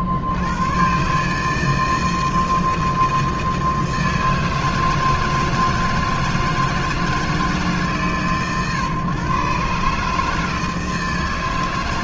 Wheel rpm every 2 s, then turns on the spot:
70, 160, 160, 160, 120, 160.
none